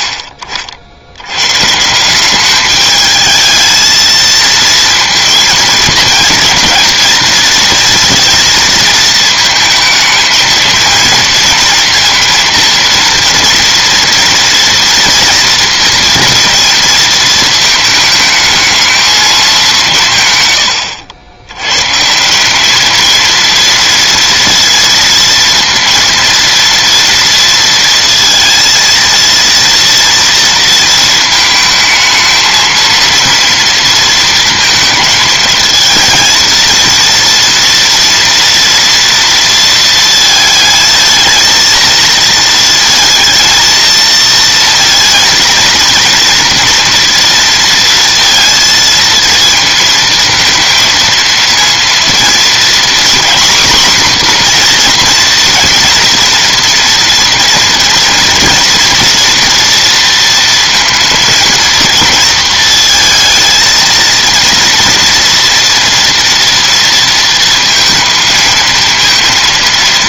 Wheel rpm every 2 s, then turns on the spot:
90, 210, 230, 230, 220, 230, 230, 230, 220, 220, 120, 210, 230, 230, 230, 230, 230, 230, 230, 230, 220, 220, 230, 230, 230, 220, 240, 240, 230, 230, 230, 220, 230, 230, 220.
none